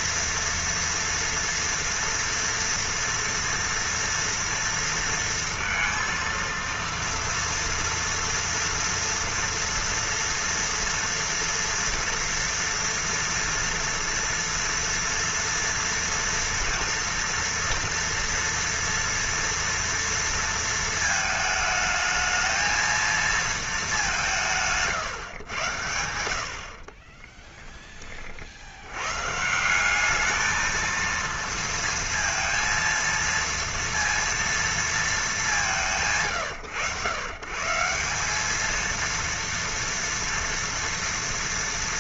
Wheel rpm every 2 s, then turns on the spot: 230, 240, 230, 230, 240, 230, 240, 240, 230, 230, 230, 220, 160, 60, 70, 220, 230, 230, 120, 220, 230.
none